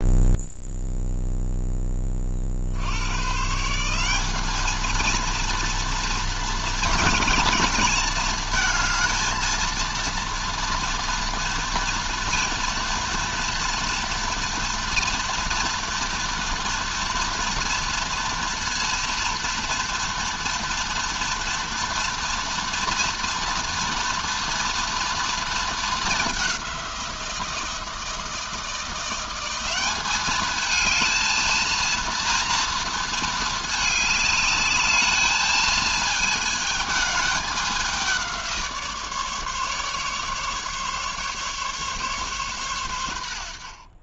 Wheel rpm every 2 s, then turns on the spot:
0, 80, 220, 230, 220, 230, 230, 230, 230, 230, 240, 230, 230, 180, 170, 220, 230, 210, 210, 160, 140, 110.
none